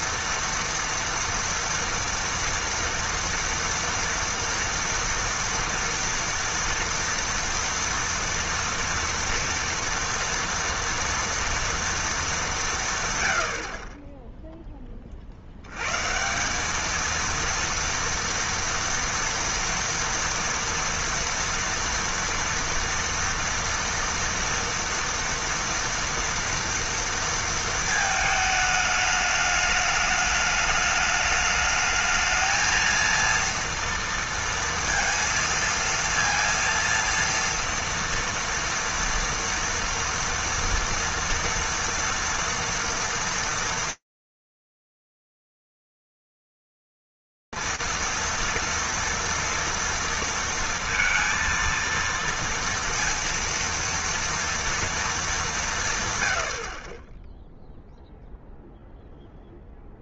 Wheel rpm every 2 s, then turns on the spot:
230, 230, 230, 230, 230, 230, 210, 10, 190, 240, 230, 240, 230, 230, 220, 210, 220, 230, 230, 230, 230, 230, 230, 230, 240, 230, 230, 230, 100, 0.
none